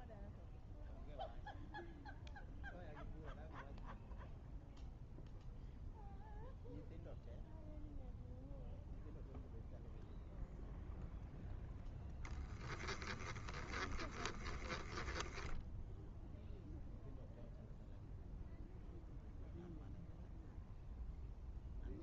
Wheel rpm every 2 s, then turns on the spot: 0, 0, 0, 0, 0, 0, 10, 10, 0, 0, 0.
12-16